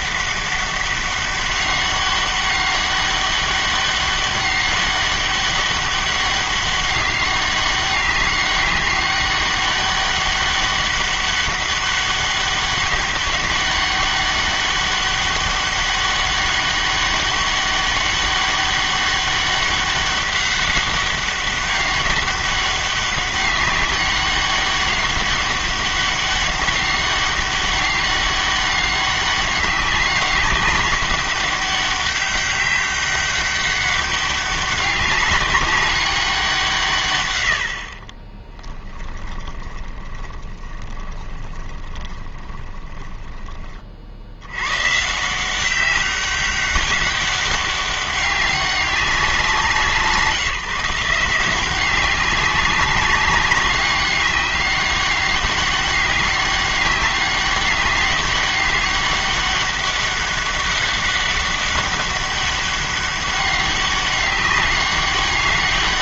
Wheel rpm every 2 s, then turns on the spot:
200, 200, 200, 200, 200, 200, 200, 200, 200, 200, 200, 200, 200, 200, 200, 190, 200, 200, 170, 10, 20, 20, 110, 200, 200, 160, 190, 190, 200, 200, 200, 200, 200.
38-44